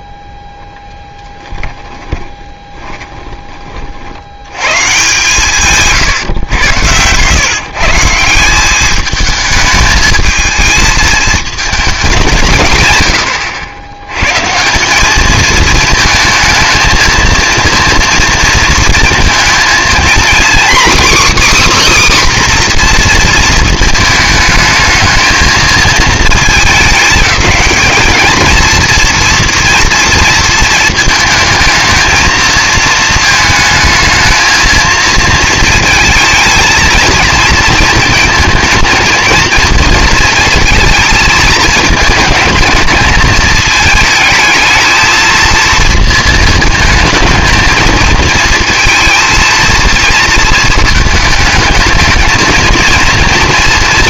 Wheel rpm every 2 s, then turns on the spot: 0, 20, 130, 100, 190, 220, 130, 170, 220, 230, 260, 250, 220, 210, 230, 220, 230, 230, 230, 220, 220, 230, 220, 220, 230, 220, 230.
2-4